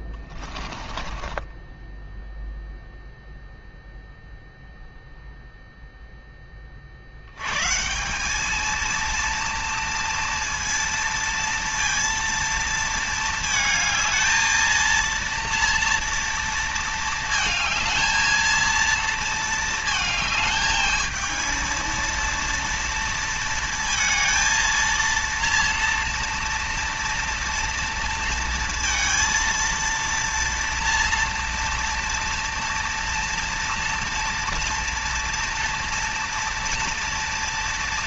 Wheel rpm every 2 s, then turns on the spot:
20, 0, 0, 50, 220, 230, 220, 230, 230, 230, 220, 230, 230, 230, 230, 230, 230, 230, 230.
0-2